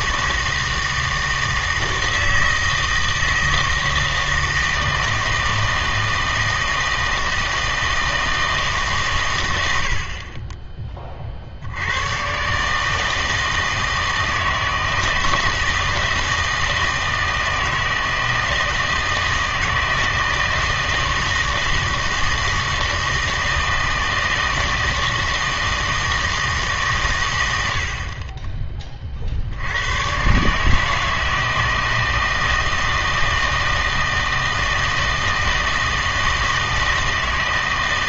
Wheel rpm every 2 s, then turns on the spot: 160, 160, 160, 160, 140, 20, 150, 160, 160, 160, 160, 160, 160, 140, 30, 160, 160, 160, 160.
none